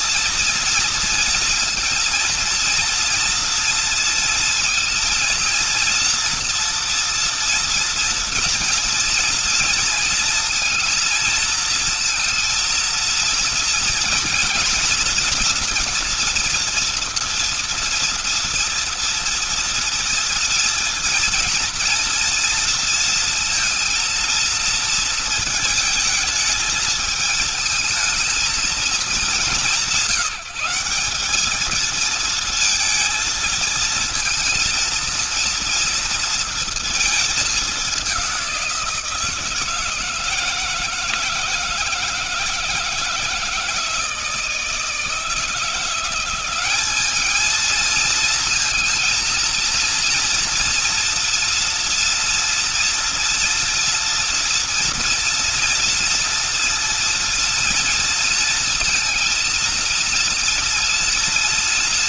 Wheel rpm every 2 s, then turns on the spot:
230, 230, 230, 230, 230, 230, 230, 240, 230, 230, 230, 230, 230, 220, 220, 190, 220, 230, 230, 180, 160, 160, 160, 190, 230, 230, 230, 230, 230, 230, 230.
none